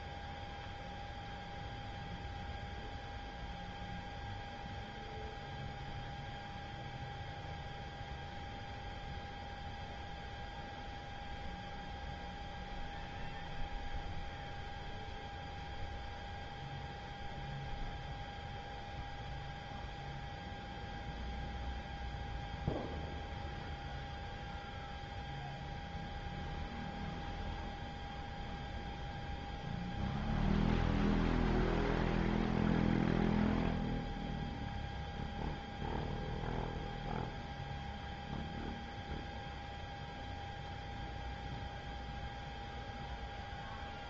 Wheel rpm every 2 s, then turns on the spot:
0, 0, 0, 0, 0, 0, 0, 0, 0, 0, 0, 0, 0, 0, 0, 0, 0, 0, 0, 0, 0, 0.
none